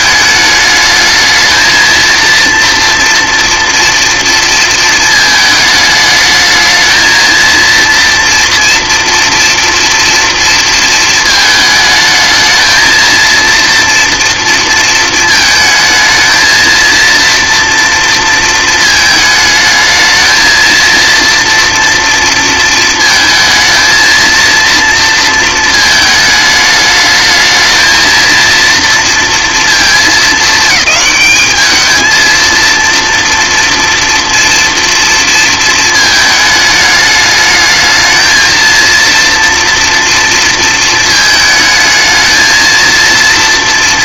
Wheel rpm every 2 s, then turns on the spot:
210, 230, 230, 220, 230, 230, 220, 230, 230, 230, 230, 230, 230, 210, 230, 210, 230, 230, 210, 230, 230, 230.
none